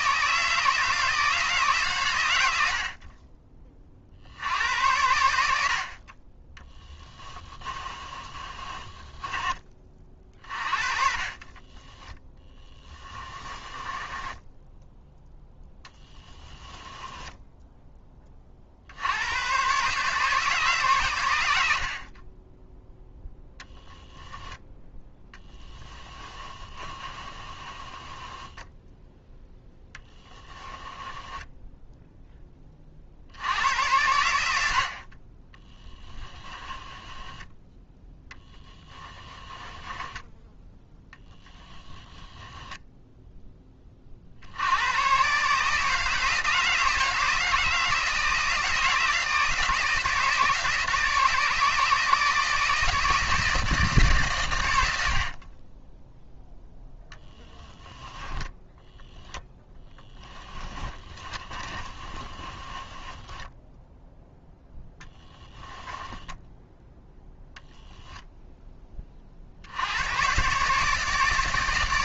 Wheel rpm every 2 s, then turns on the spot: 160, 50, 90, 10, 30, 30, 10, 0, 10, 60, 130, 10, 10, 30, 10, 10, 30, 50, 20, 10, 20, 10, 100, 160, 160, 160, 160, 90, 10, 10, 20, 30, 0, 0, 20, 150.
6-10 12-14 16-18 26-32 36-42 56-58 60-64